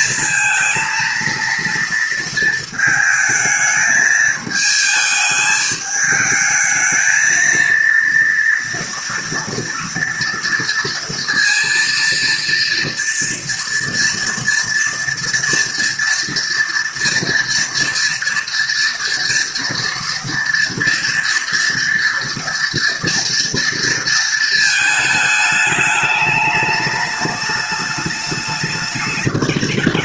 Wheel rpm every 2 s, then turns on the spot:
230, 230, 220, 220, 230, 230, 230, 230, 240, 230, 230, 230, 220, 210, 210.
none